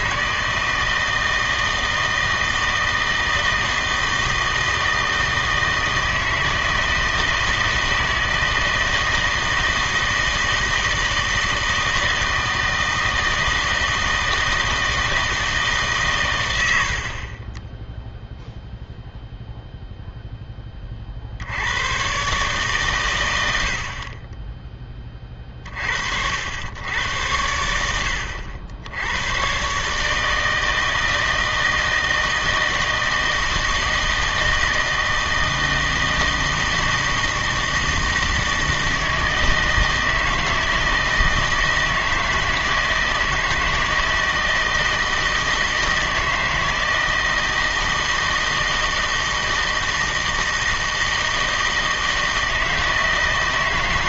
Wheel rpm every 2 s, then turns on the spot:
160, 160, 160, 160, 160, 160, 160, 160, 80, 0, 10, 140, 20, 90, 70, 160, 160, 160, 160, 160, 160, 160, 160, 160, 160, 160, 160.
none